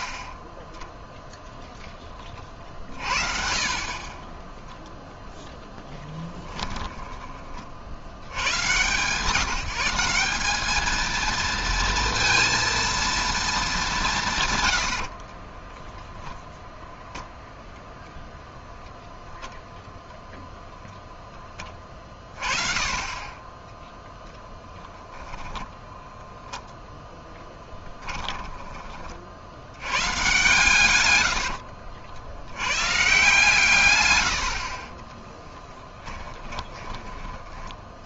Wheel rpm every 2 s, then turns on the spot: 10, 40, 10, 10, 110, 210, 230, 100, 0, 0, 0, 20, 0, 0, 20, 130, 110, 50, 20.
6-8 36-38